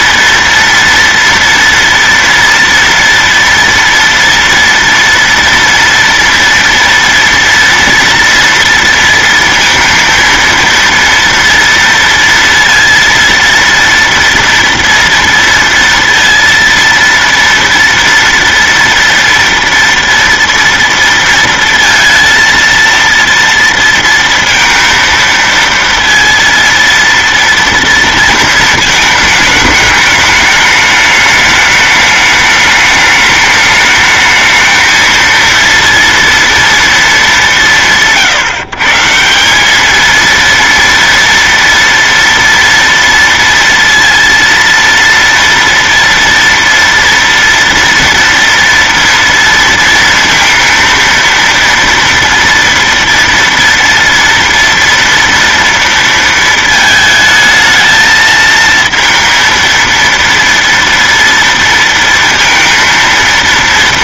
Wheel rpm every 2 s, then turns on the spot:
230, 230, 230, 230, 230, 230, 230, 230, 230, 230, 230, 230, 230, 230, 220, 210, 210, 220, 230, 160, 230, 230, 230, 230, 230, 230, 230, 230, 220, 230, 230, 230.
none